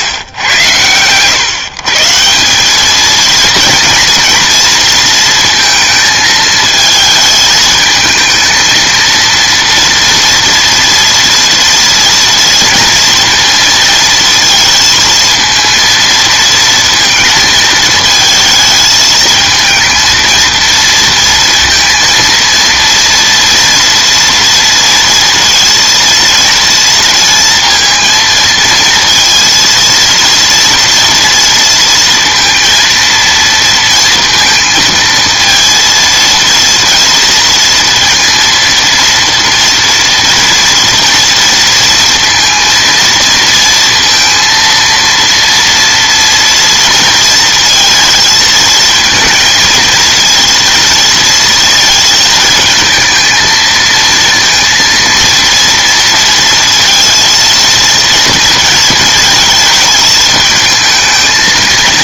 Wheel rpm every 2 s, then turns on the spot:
110, 200, 230, 220, 230, 240, 230, 220, 230, 220, 230, 230, 230, 230, 230, 230, 230, 230, 230, 230, 230, 230, 230, 230, 220, 230, 220, 230, 230, 230, 220.
none